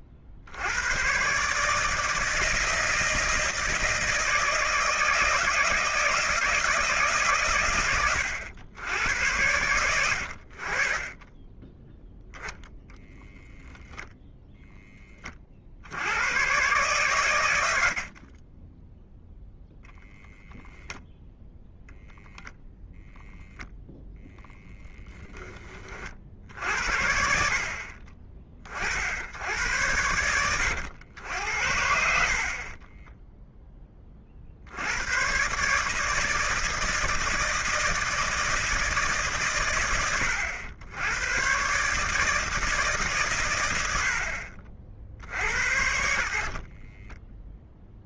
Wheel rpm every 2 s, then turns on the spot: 90, 160, 160, 170, 100, 50, 0, 10, 120, 10, 10, 0, 0, 70, 50, 100, 30, 70, 160, 160, 90, 150, 70, 30.
18-20 32-34 46-48